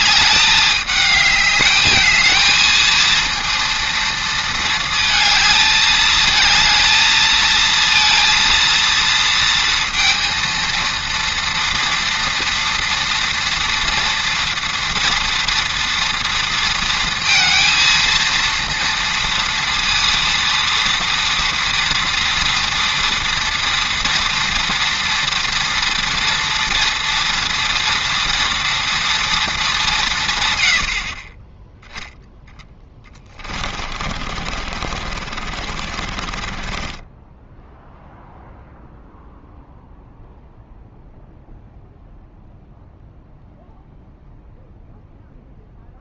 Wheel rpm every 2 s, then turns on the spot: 210, 220, 230, 220, 230, 230, 230, 230, 230, 230, 230, 230, 230, 240, 230, 100, 10, 50, 30, 0, 0, 0, 0.
32-38